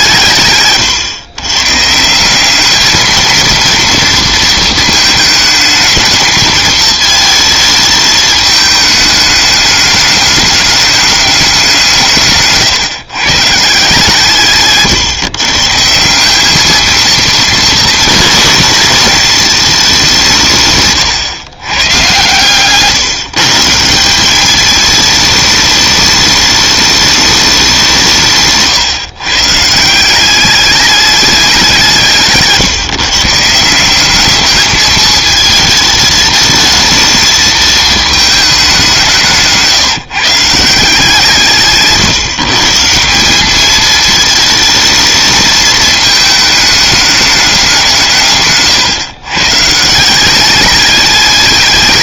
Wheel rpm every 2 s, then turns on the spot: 130, 200, 220, 220, 220, 210, 140, 140, 210, 220, 140, 130, 210, 210, 140, 200, 140, 210, 220, 200, 160, 150, 220, 220, 130, 200.
0-2 20-22 48-50